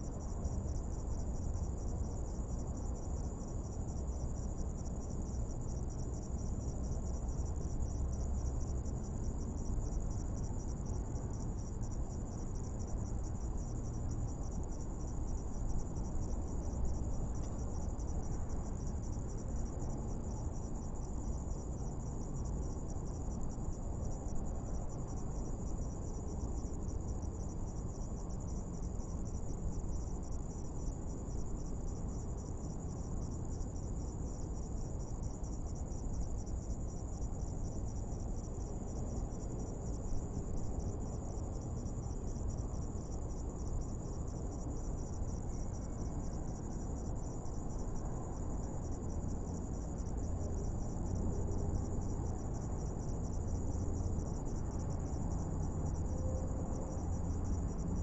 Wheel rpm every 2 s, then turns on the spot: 0, 0, 0, 0, 0, 0, 0, 0, 0, 0, 0, 0, 0, 0, 0, 0, 0, 0, 0, 0, 0, 0, 0, 0, 0, 0, 0, 0, 0.
none